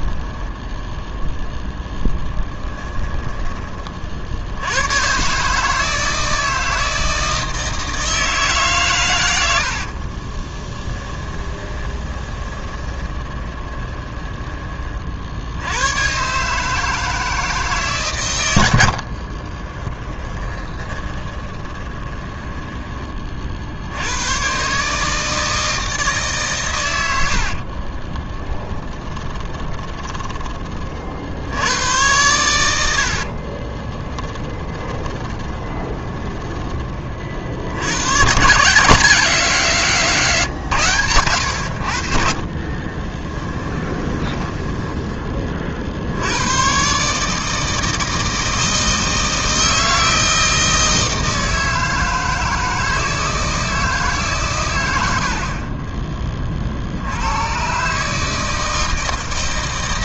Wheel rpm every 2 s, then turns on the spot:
10, 20, 100, 160, 130, 10, 20, 30, 150, 70, 20, 20, 140, 110, 20, 40, 80, 20, 20, 160, 120, 30, 10, 120, 160, 160, 160, 100, 50, 160.
2-4 10-14 18-22 28-30 32-36 42-46